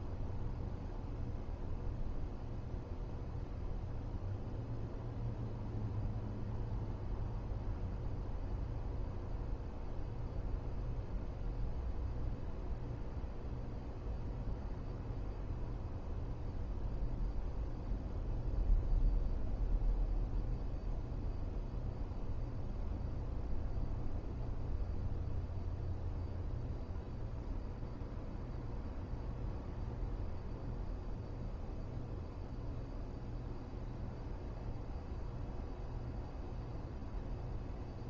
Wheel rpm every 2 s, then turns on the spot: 0, 0, 0, 0, 0, 0, 0, 0, 0, 0, 0, 0, 0, 0, 0, 0, 0, 0, 0.
none